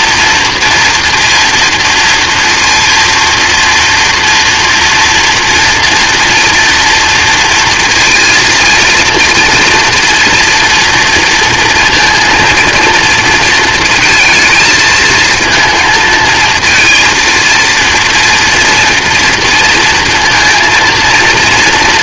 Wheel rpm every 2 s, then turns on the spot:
230, 230, 230, 230, 230, 230, 230, 220, 220, 230, 230.
none